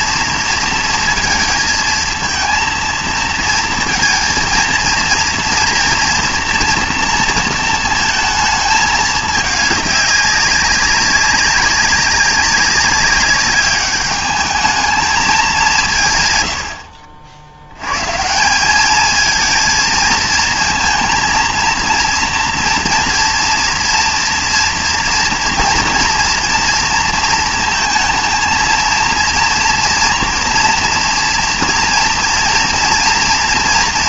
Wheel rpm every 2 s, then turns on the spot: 230, 230, 230, 230, 220, 200, 190, 210, 110, 180, 220, 230, 230, 230, 230, 230, 230.
none